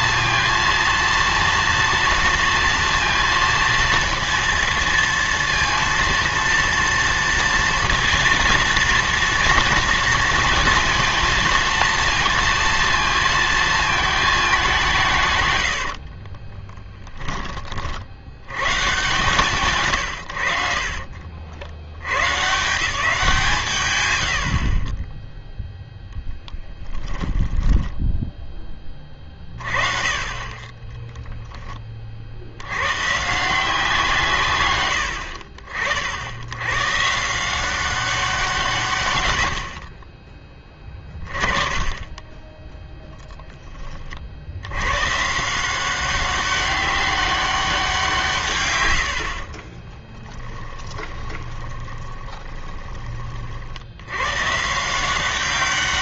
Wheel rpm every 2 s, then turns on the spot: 230, 230, 230, 230, 230, 220, 230, 190, 10, 120, 50, 150, 40, 20, 20, 20, 70, 110, 110, 160, 20, 10, 90, 200, 120, 20, 20, 150.
16-18 26-28 50-54